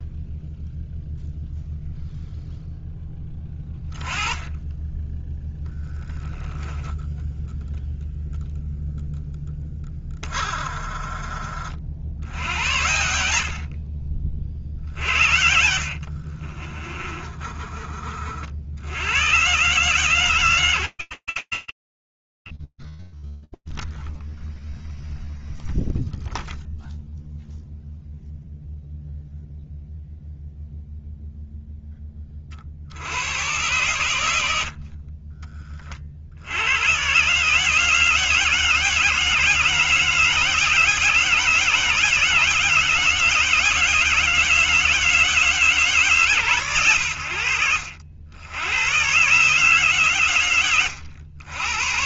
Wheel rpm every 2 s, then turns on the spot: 0, 0, 20, 10, 0, 20, 80, 50, 30, 50, 150, 30, 0, 0, 0, 0, 80, 30, 120, 160, 160, 160, 160, 100, 120, 90.
6-8 16-18